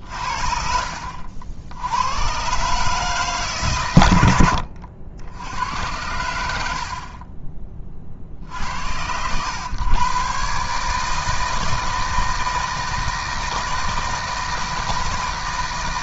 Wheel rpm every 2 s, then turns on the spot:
60, 140, 70, 60, 70, 150, 160, 160.
0-2 6-8